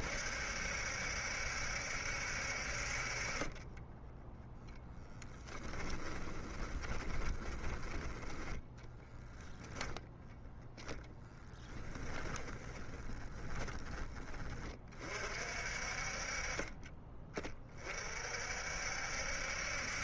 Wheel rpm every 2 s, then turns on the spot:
70, 50, 0, 20, 10, 0, 10, 20, 40, 60.
6-8 12-14